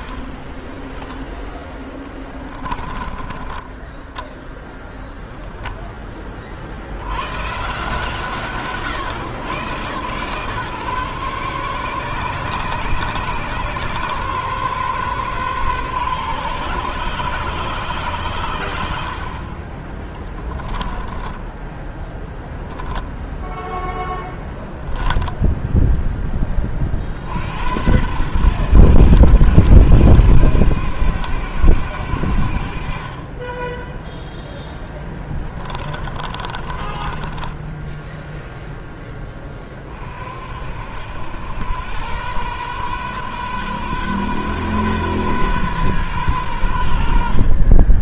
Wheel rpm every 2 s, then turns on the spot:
10, 10, 20, 140, 130, 130, 130, 130, 110, 10, 0, 0, 10, 90, 110, 100, 20, 20, 20, 10, 70, 120, 130, 80.
0-4 34-38